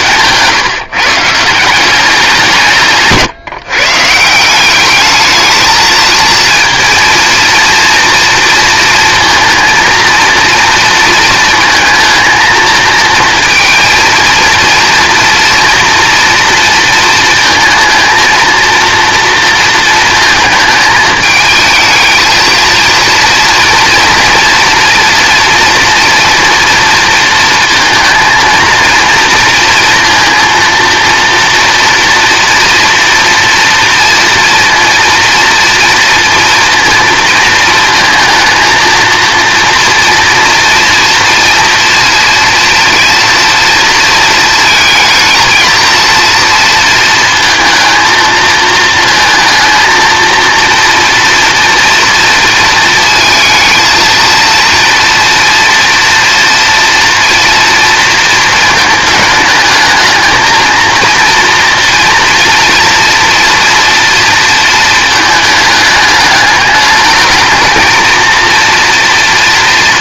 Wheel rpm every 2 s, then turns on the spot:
150, 160, 200, 230, 230, 230, 230, 230, 230, 230, 220, 230, 230, 230, 230, 230, 230, 230, 230, 230, 230, 230, 220, 230, 220, 230, 230, 230, 230, 220, 230, 240, 220, 210, 230.
none